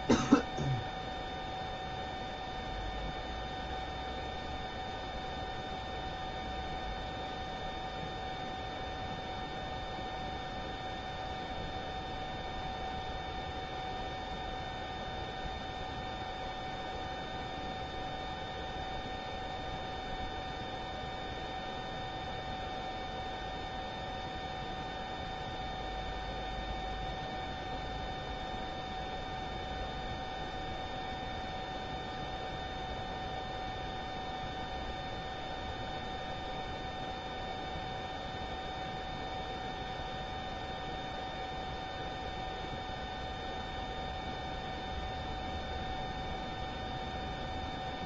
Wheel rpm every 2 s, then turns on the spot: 0, 0, 0, 0, 0, 0, 0, 0, 0, 0, 0, 0, 0, 0, 0, 0, 0, 0, 0, 0, 0, 0, 0, 0.
none